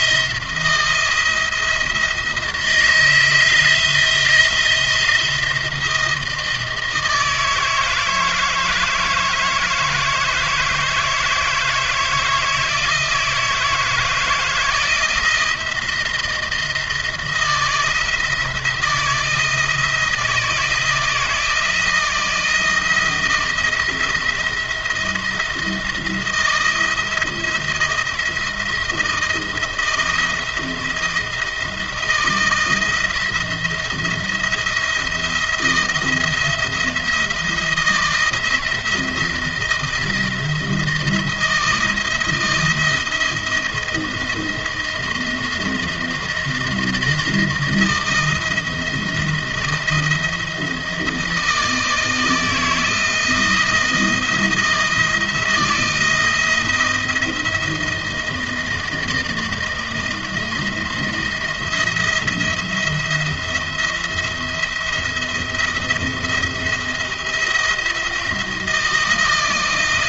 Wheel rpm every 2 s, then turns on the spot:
170, 170, 170, 160, 160, 160, 160, 160, 170, 160, 160, 170, 170, 170, 160, 170, 160, 170, 170, 170, 170, 170, 170, 170, 170, 160, 160, 170, 170, 160, 170, 170, 170, 170, 170.
none